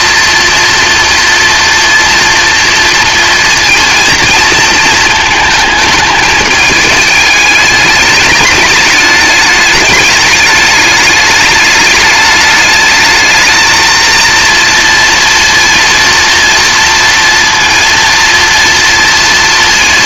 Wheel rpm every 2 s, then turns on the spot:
230, 230, 230, 210, 210, 210, 210, 230, 230, 230.
none